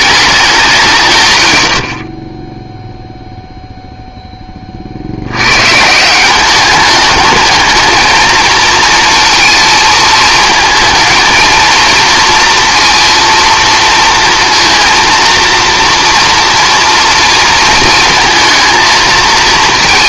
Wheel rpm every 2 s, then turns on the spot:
160, 0, 40, 200, 230, 230, 230, 230, 230, 230.
none